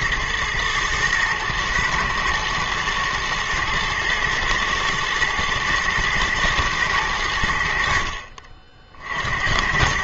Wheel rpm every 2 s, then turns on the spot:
110, 110, 110, 110, 60.
none